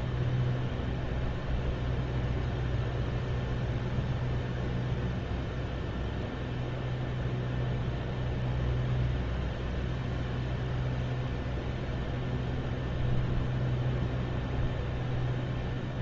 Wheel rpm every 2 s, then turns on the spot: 0, 0, 0, 0, 0, 0, 0, 0.
none